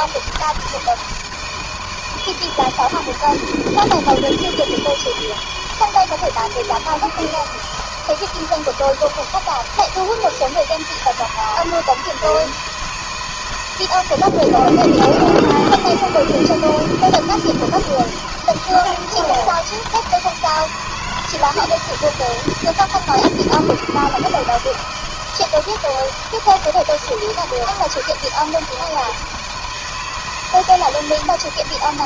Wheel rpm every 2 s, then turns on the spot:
160, 160, 170, 160, 160, 160, 160, 160, 160, 160, 160, 160, 160, 160, 160, 160.
none